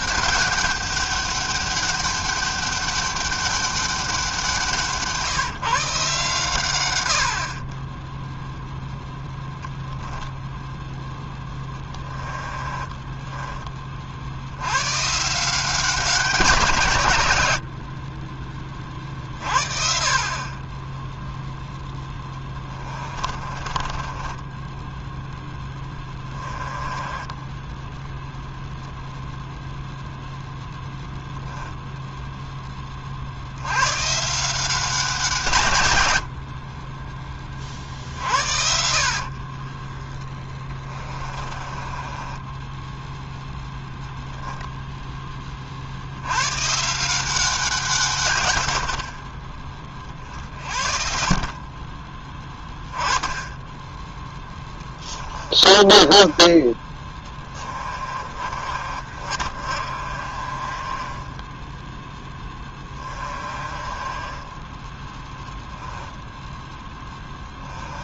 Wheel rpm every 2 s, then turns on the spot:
200, 200, 170, 120, 0, 0, 20, 110, 140, 40, 20, 20, 10, 20, 0, 0, 20, 180, 30, 70, 20, 10, 0, 140, 90, 50, 20, 10, 20, 40, 20, 20, 10, 10.
12-14 22-28 40-44 54-56 58-68